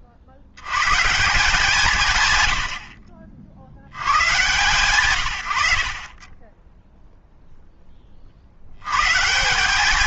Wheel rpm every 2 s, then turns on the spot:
100, 90, 140, 10, 60.
6-8